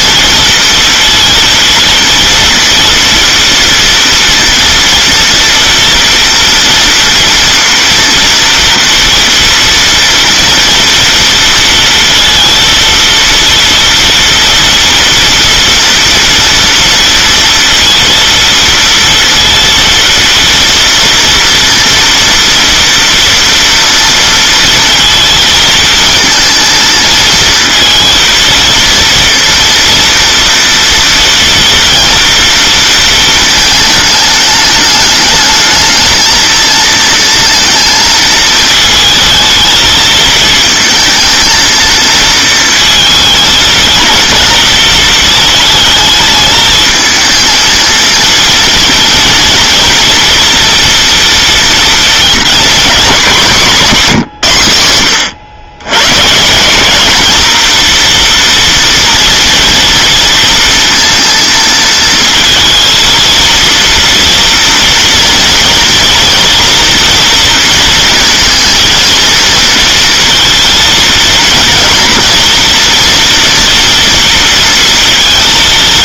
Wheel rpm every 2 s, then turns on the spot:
230, 230, 230, 230, 230, 230, 230, 230, 230, 230, 230, 230, 230, 230, 230, 230, 230, 210, 220, 220, 220, 230, 220, 220, 230, 240, 240, 150, 160, 240, 230, 230, 240, 230, 230, 230, 230, 230.
none